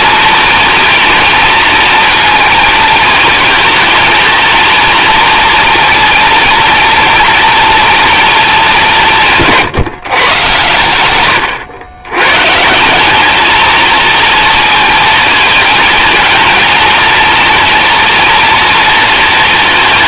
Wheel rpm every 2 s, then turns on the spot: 230, 220, 230, 230, 190, 110, 160, 230, 230, 230.
none